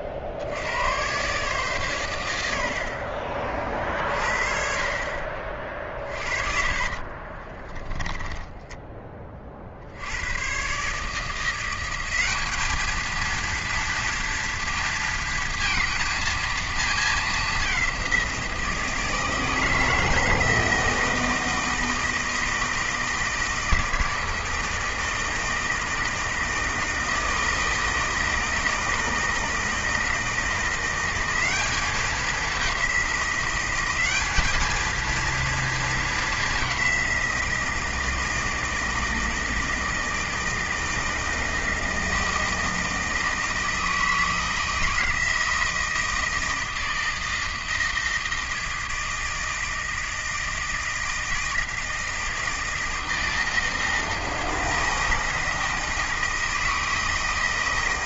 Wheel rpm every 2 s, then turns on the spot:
100, 70, 50, 40, 10, 130, 210, 230, 220, 170, 160, 160, 160, 160, 160, 170, 200, 220, 200, 160, 160, 160, 160, 160, 160, 160, 160, 160, 160.
6-8